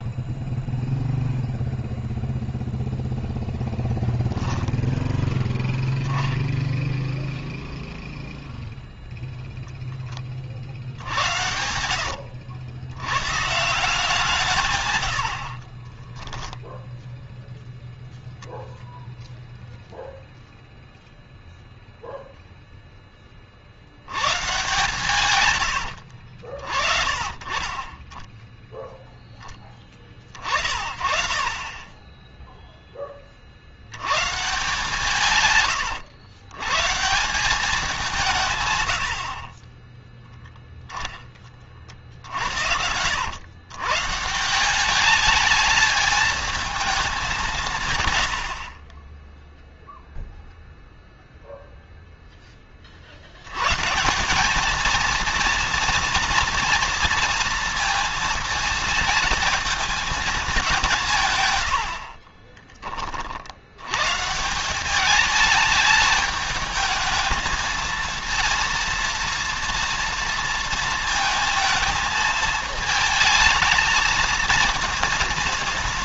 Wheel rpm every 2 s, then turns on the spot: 0, 0, 0, 0, 0, 70, 100, 110, 0, 0, 0, 10, 130, 40, 0, 40, 20, 150, 130, 120, 10, 90, 190, 210, 50, 0, 50, 220, 230, 220, 170, 40, 190, 210, 230, 230, 220, 230.
14-16